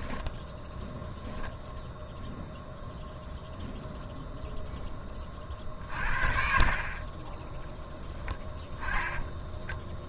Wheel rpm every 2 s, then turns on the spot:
0, 0, 0, 40, 10.
8-10